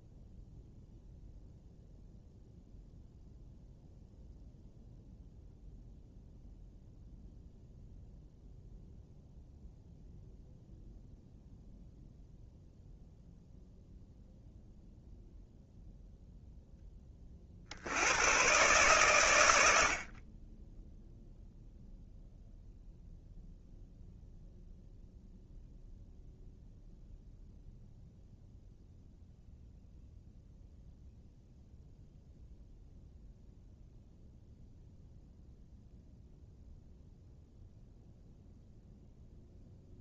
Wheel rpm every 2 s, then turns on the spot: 0, 0, 0, 0, 0, 0, 0, 0, 10, 110, 0, 0, 0, 0, 0, 0, 0, 0, 0, 0.
none